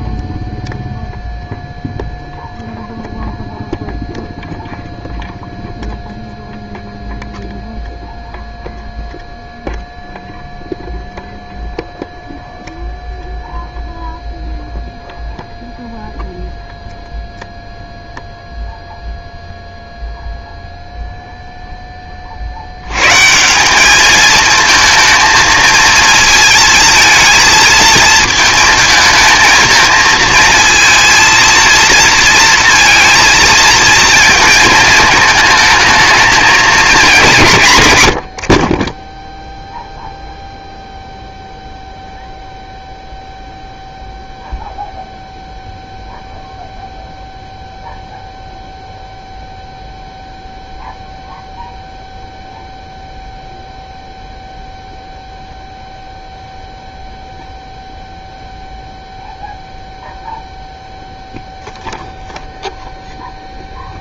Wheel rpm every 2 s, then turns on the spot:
0, 0, 0, 0, 0, 0, 0, 0, 0, 0, 0, 90, 220, 220, 220, 230, 230, 220, 220, 30, 0, 0, 0, 0, 0, 0, 0, 0, 0, 0, 0, 0.
none